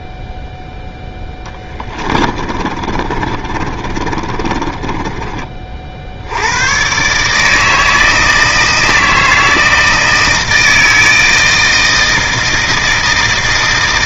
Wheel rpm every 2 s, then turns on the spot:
10, 30, 30, 140, 160, 160, 160.
0-6